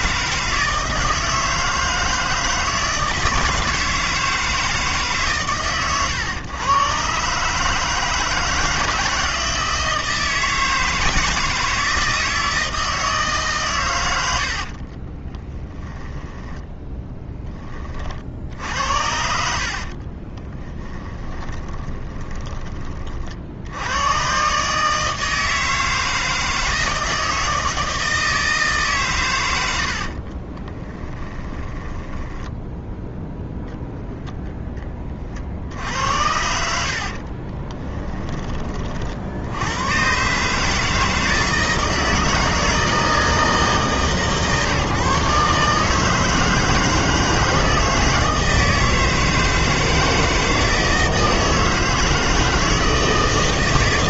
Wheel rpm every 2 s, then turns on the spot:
160, 160, 160, 120, 160, 160, 160, 60, 10, 70, 20, 20, 140, 160, 150, 20, 10, 10, 70, 30, 150, 160, 140, 160, 160, 160, 160.
14-16 20-22 30-34 36-38